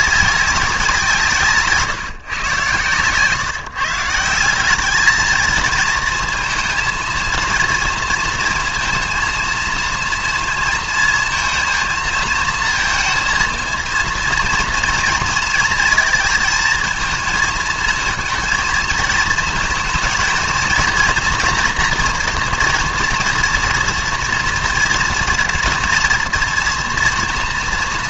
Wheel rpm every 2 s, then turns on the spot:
190, 130, 200, 230, 230, 230, 230, 230, 230, 230, 230, 240, 230, 230.
none